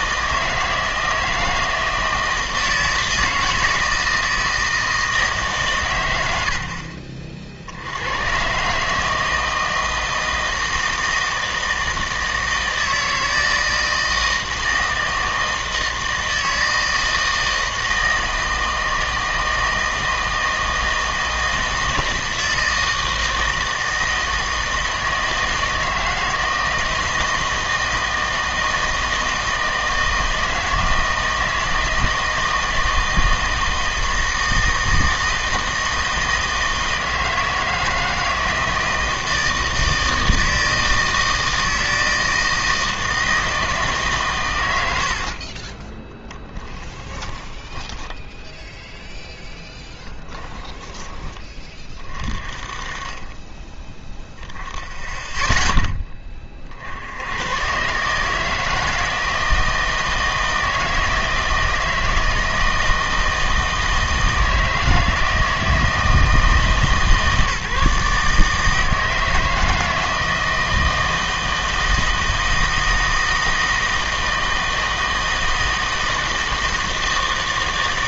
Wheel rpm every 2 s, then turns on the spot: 160, 160, 160, 80, 140, 160, 160, 160, 160, 160, 160, 160, 160, 160, 160, 160, 160, 160, 160, 160, 160, 160, 90, 10, 0, 10, 30, 10, 50, 160, 160, 160, 160, 160, 160, 160, 160, 160, 160.
44-46 50-52